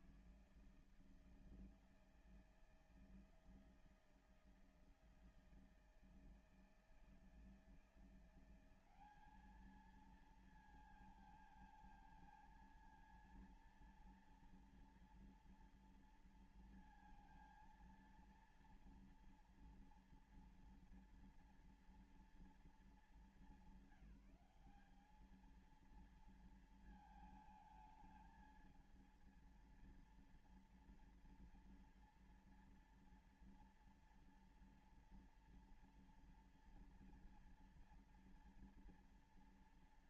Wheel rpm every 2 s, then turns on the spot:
160, 160, 160, 160, 170, 220, 220, 230, 230, 230, 230, 230, 200, 220, 220, 230, 230, 240, 230, 230.
none